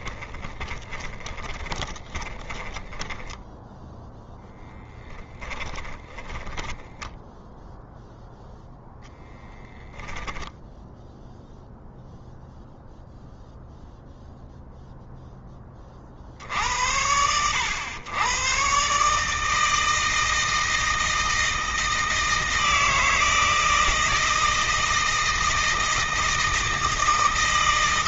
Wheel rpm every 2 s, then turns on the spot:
20, 10, 10, 20, 0, 0, 0, 0, 80, 140, 160, 160, 160, 160.
0-4 6-8